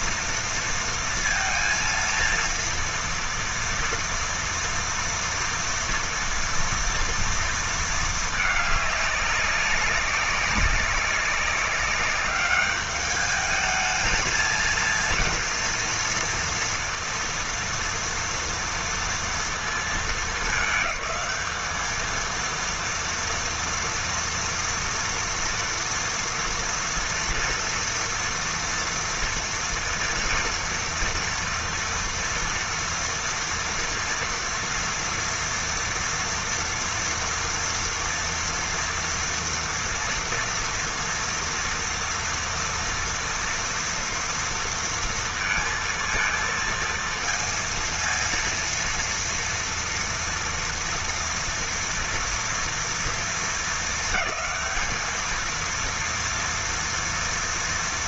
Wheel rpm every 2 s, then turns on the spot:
230, 230, 230, 230, 200, 200, 210, 230, 230, 230, 210, 230, 230, 230, 230, 230, 230, 230, 230, 230, 230, 230, 230, 230, 230, 240, 230, 220, 230.
none